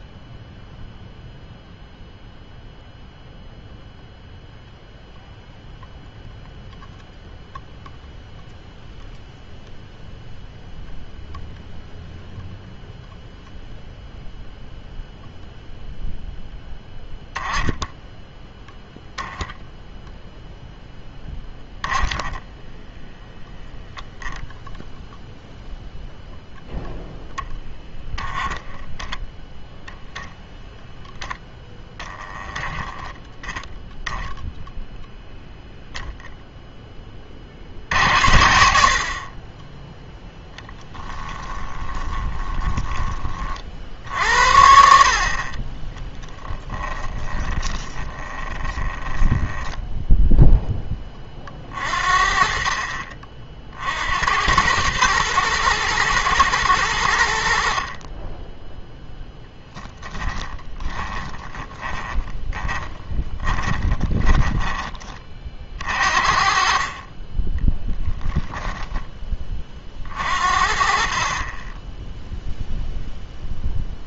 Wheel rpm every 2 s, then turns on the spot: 0, 0, 0, 0, 0, 0, 0, 0, 10, 10, 0, 10, 0, 0, 10, 0, 10, 0, 10, 70, 10, 20, 60, 10, 20, 10, 40, 100, 110, 10, 10, 20, 20, 40, 10, 40, 0.
40-44 46-50 60-66